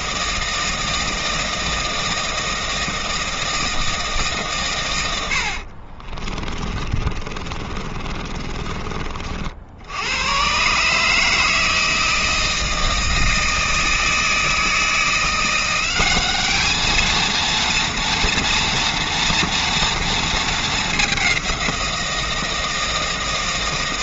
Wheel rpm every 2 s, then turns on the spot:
160, 160, 140, 30, 30, 120, 160, 160, 200, 230, 220, 160.
6-10